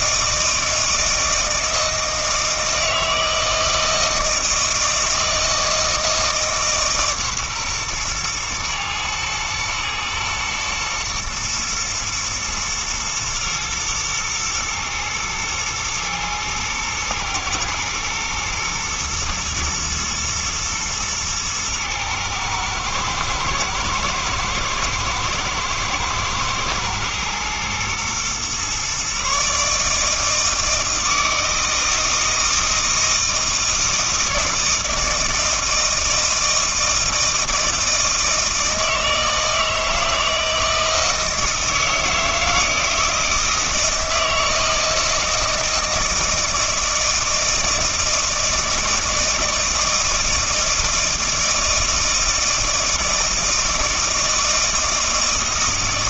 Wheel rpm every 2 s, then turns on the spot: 160, 160, 160, 150, 120, 120, 110, 110, 110, 120, 110, 110, 110, 110, 130, 160, 160, 160, 160, 160, 160, 160, 160, 160, 160, 160, 160, 160.
none